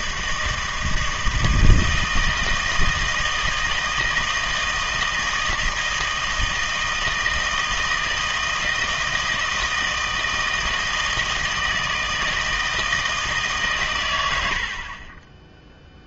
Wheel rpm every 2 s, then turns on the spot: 160, 160, 160, 160, 160, 160, 160, 80.
none